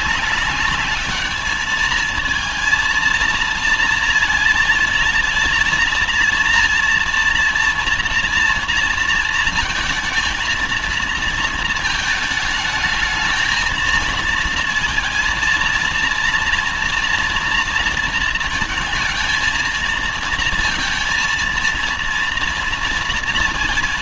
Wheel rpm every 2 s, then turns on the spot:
200, 220, 230, 230, 230, 220, 220, 230, 230, 220, 230, 230.
none